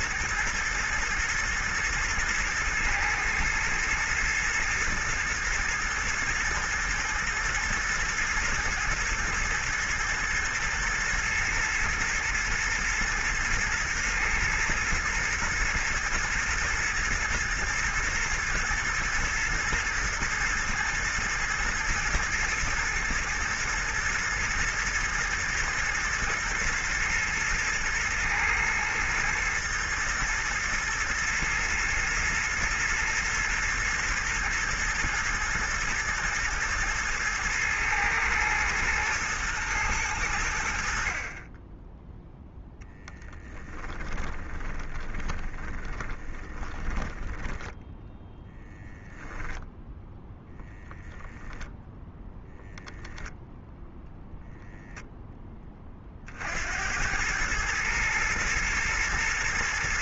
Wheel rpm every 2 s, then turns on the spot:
110, 110, 110, 110, 110, 110, 120, 110, 110, 120, 110, 110, 120, 110, 110, 120, 120, 120, 120, 110, 50, 10, 20, 10, 0, 0, 0, 0, 90, 110.
42-48